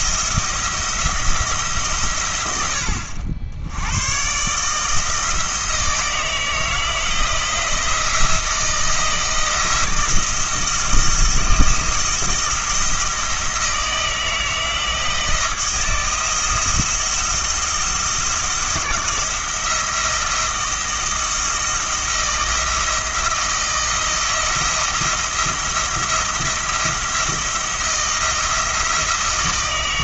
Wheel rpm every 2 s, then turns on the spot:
170, 90, 140, 160, 170, 170, 170, 160, 170, 170, 160, 160, 160, 170, 170.
none